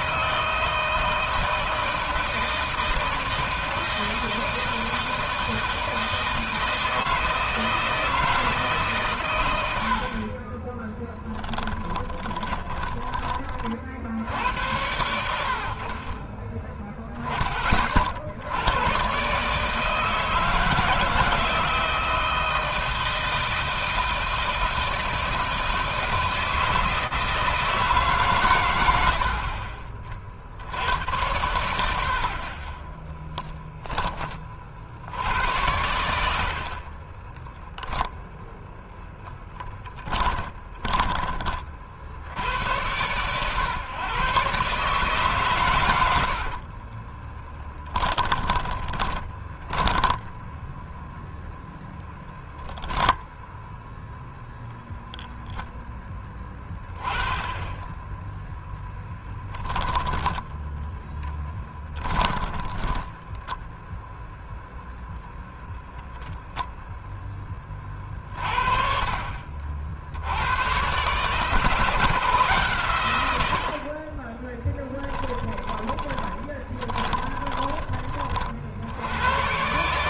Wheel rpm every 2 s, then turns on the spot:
160, 160, 160, 160, 140, 20, 10, 90, 10, 100, 160, 160, 160, 160, 100, 80, 30, 50, 30, 0, 20, 100, 140, 40, 30, 10, 0, 0, 10, 0, 0, 10, 0, 0, 50, 120, 120, 10, 20, 80.
10-14 32-34 36-38 46-50 62-64 74-78